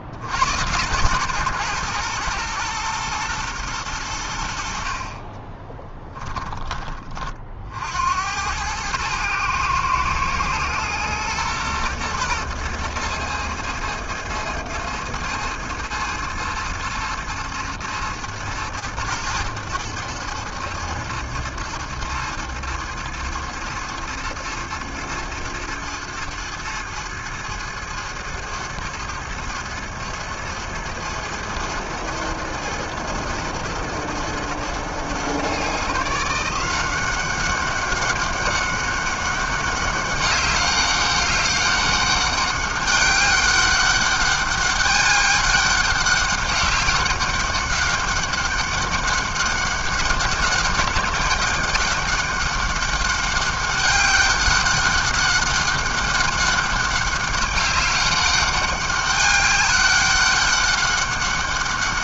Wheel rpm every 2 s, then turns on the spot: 90, 120, 60, 10, 100, 120, 110, 110, 110, 110, 110, 110, 110, 110, 110, 110, 110, 110, 170, 200, 200, 200, 200, 200, 200, 200, 200, 200, 190, 200, 200.
none